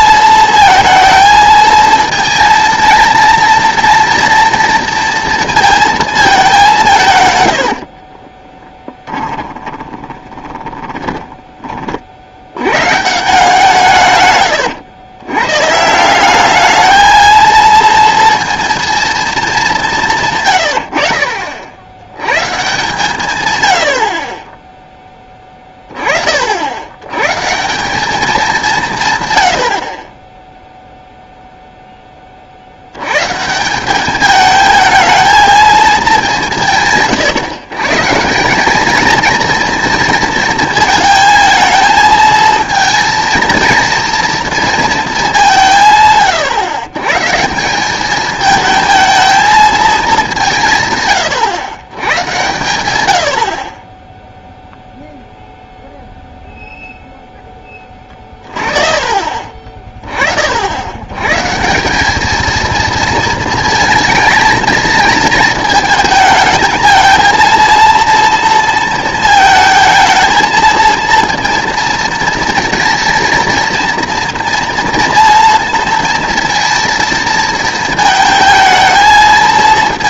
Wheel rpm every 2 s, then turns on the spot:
220, 230, 230, 200, 20, 20, 100, 110, 200, 230, 100, 150, 20, 60, 190, 0, 60, 220, 170, 190, 230, 220, 230, 120, 220, 170, 120, 0, 0, 40, 60, 220, 230, 220, 230, 230, 230, 230, 230, 220.
8-12